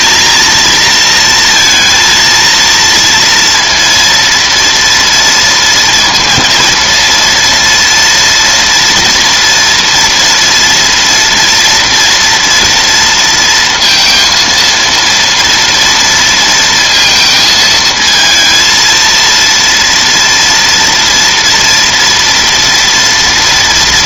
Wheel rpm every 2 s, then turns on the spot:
230, 230, 230, 230, 240, 230, 240, 230, 230, 230, 230, 230.
none